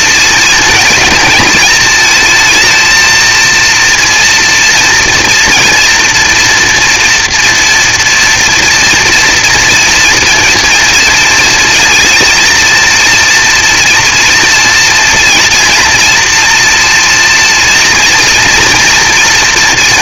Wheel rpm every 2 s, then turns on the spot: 230, 230, 230, 240, 230, 230, 230, 230, 240, 230.
none